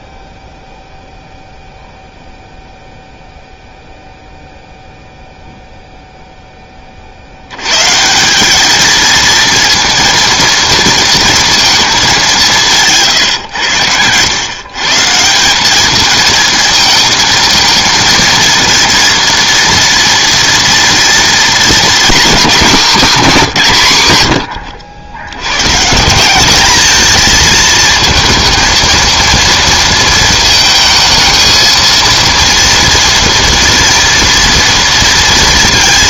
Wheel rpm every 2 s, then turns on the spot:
0, 0, 0, 30, 220, 230, 160, 140, 220, 230, 230, 250, 100, 210, 230, 220, 230, 230.
none